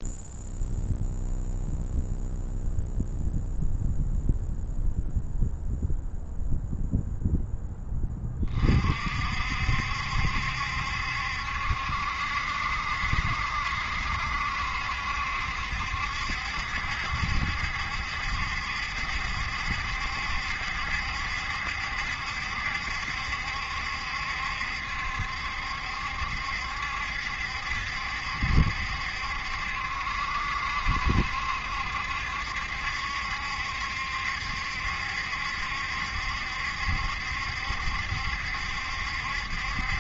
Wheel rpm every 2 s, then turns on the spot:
0, 0, 0, 0, 40, 70, 70, 70, 70, 70, 70, 70, 70, 70, 70, 70, 70, 70, 70, 70.
none